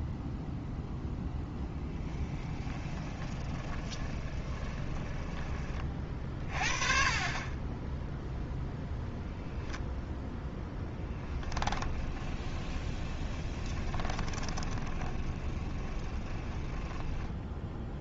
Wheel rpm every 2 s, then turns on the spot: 0, 20, 20, 30, 0, 10, 20, 30, 10.
2-6 10-18